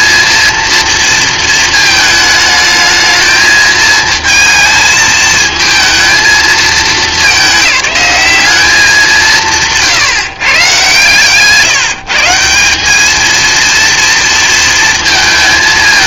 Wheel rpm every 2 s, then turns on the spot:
230, 220, 220, 210, 200, 130, 200, 230.
none